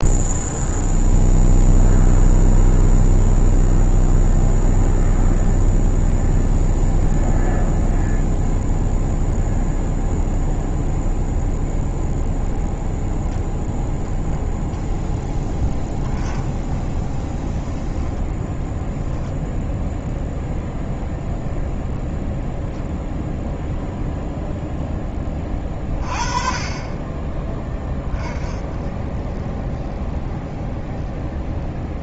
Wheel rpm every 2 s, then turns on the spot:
0, 0, 0, 0, 0, 0, 0, 0, 20, 10, 0, 0, 10, 20, 20, 10.
none